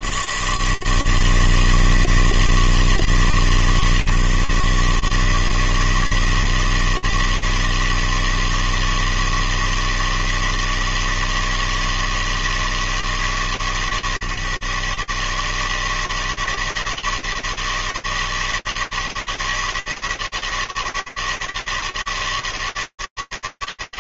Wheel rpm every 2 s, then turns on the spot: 80, 160, 130, 160, 160, 160, 160, 150, 160, 160, 160, 160.
none